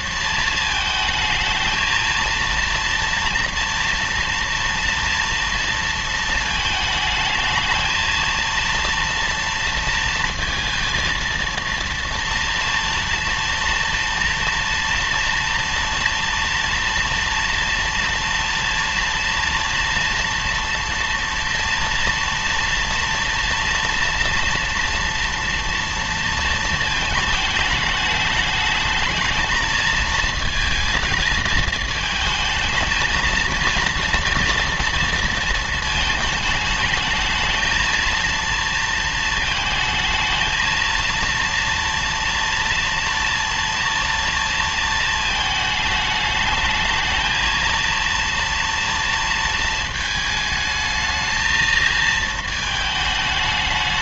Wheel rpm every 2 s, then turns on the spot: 220, 230, 230, 220, 230, 230, 230, 230, 230, 230, 240, 230, 230, 220, 220, 220, 220, 230, 220, 230, 220, 230, 230, 210, 230, 220, 220.
none